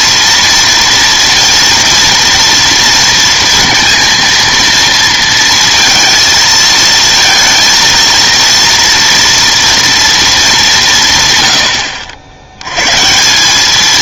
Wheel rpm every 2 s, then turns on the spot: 230, 230, 230, 230, 230, 210, 100.
none